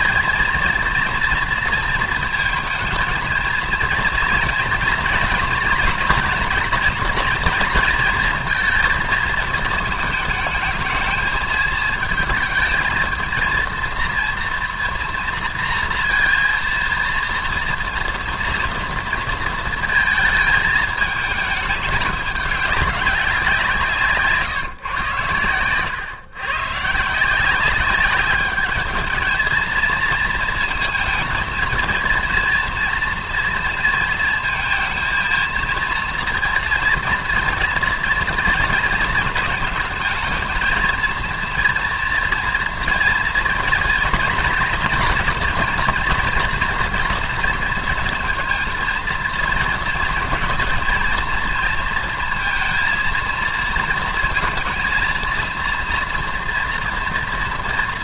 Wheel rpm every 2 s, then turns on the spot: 230, 230, 230, 230, 220, 220, 220, 230, 230, 230, 220, 200, 130, 140, 220, 220, 230, 230, 230, 230, 230, 230, 240, 230, 230, 230, 230, 230, 240.
none